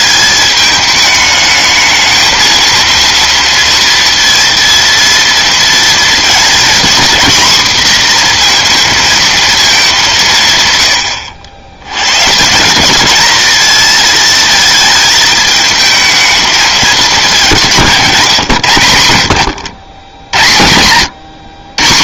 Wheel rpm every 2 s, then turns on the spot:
210, 230, 230, 230, 230, 130, 180, 220, 210, 100, 100.
none